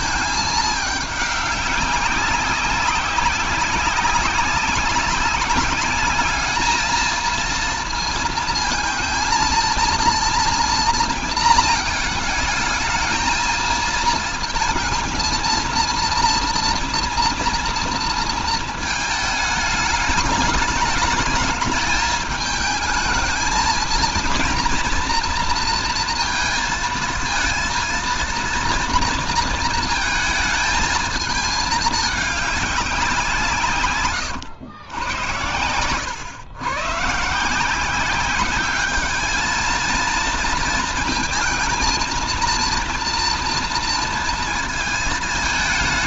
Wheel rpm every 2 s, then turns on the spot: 220, 190, 190, 220, 230, 240, 210, 230, 230, 220, 210, 220, 230, 230, 230, 220, 200, 110, 110, 200, 230, 230, 220.
none